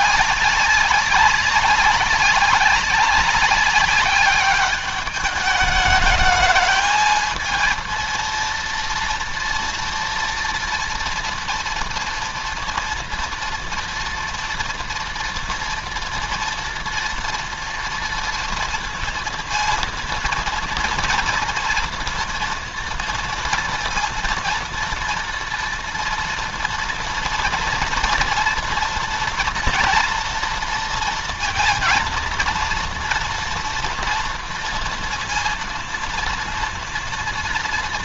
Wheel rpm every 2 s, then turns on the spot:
200, 190, 200, 220, 230, 230, 230, 230, 230, 230, 240, 230, 230, 230, 240, 230, 230, 230, 230.
none